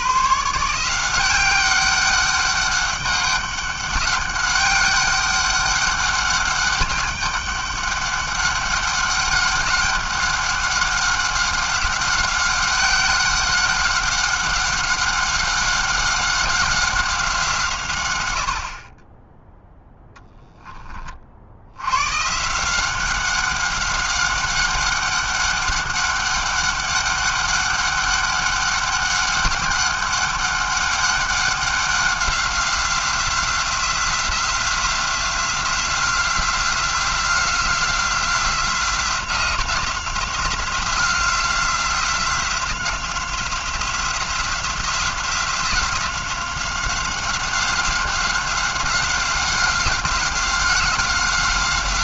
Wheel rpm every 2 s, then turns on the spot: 120, 200, 200, 200, 200, 200, 190, 190, 190, 110, 0, 120, 190, 200, 200, 200, 190, 180, 180, 180, 180, 180, 180, 180, 190, 180.
none